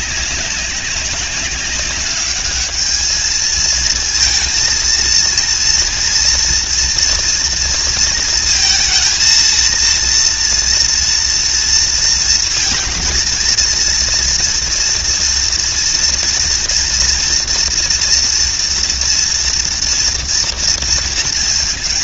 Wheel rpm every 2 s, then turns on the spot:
200, 220, 230, 230, 230, 230, 230, 230, 230, 230, 230.
none